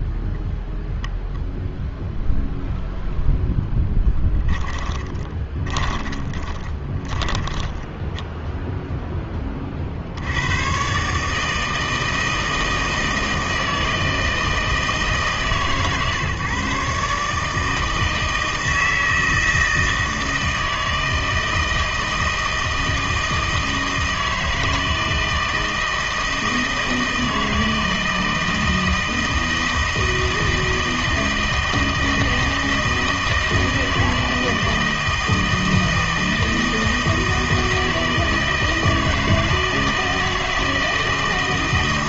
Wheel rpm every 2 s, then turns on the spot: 0, 0, 20, 20, 0, 110, 160, 160, 140, 160, 160, 160, 160, 160, 160, 160, 160, 160, 160, 160, 160.
4-8